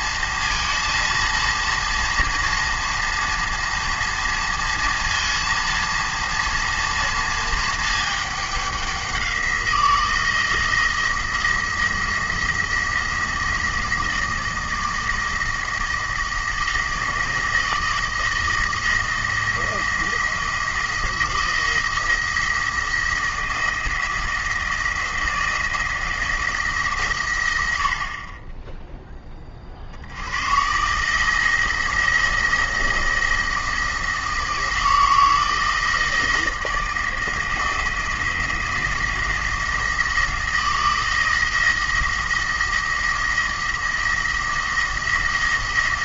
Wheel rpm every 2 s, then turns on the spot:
230, 230, 230, 230, 200, 170, 170, 160, 160, 160, 160, 170, 170, 160, 10, 130, 160, 160, 160, 170, 170, 170, 170.
none